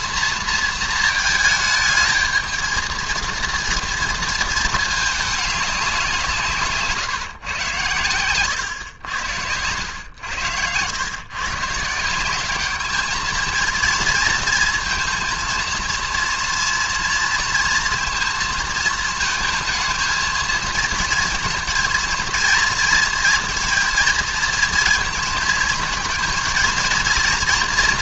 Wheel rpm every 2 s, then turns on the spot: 230, 220, 220, 140, 100, 110, 210, 230, 230, 230, 230, 230, 230, 230.
6-10